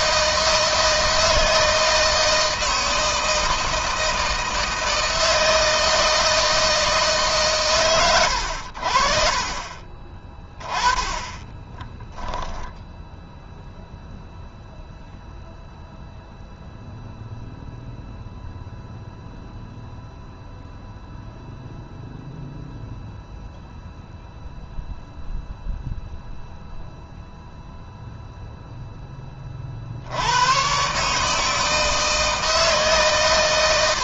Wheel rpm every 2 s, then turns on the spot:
160, 160, 160, 150, 60, 20, 0, 0, 0, 0, 0, 0, 0, 0, 10, 140, 130.
10-12